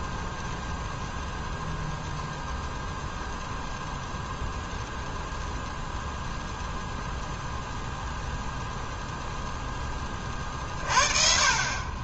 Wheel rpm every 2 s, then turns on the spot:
0, 0, 0, 0, 0, 40.
none